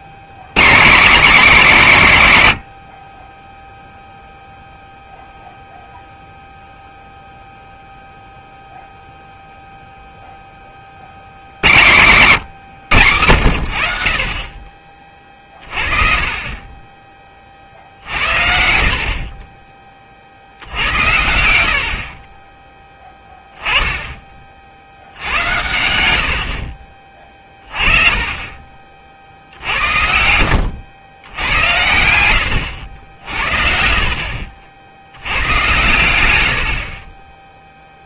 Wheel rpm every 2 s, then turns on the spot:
170, 100, 0, 0, 0, 20, 140, 30, 30, 60, 80, 10, 60, 60, 30, 90, 90, 70, 60.
none